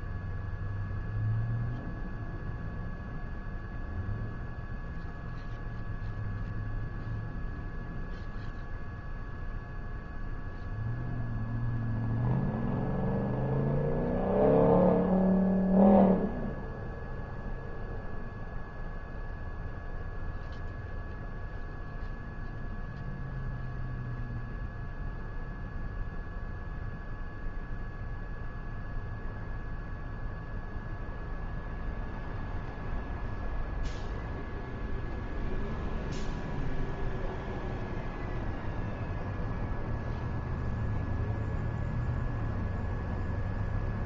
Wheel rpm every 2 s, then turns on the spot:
0, 0, 0, 0, 0, 0, 0, 0, 0, 0, 0, 0, 0, 0, 0, 0, 0, 0, 0, 0, 0, 0.
none